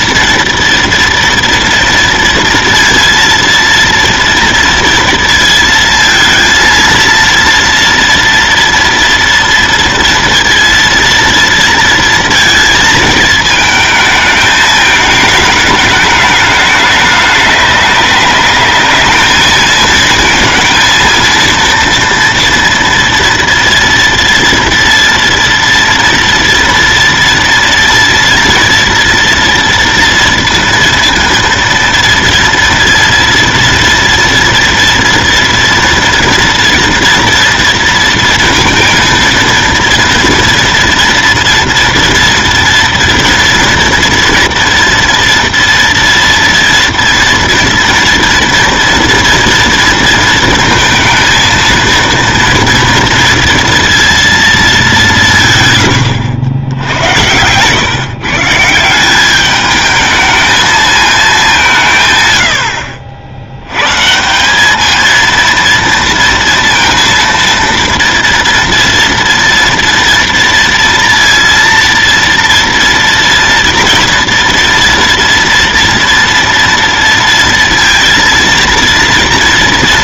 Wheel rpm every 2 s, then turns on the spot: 230, 230, 230, 230, 230, 230, 220, 220, 210, 210, 230, 240, 230, 230, 230, 230, 230, 230, 240, 230, 230, 230, 240, 230, 230, 230, 230, 200, 90, 170, 220, 60, 210, 230, 230, 230, 240, 230, 230, 230.
none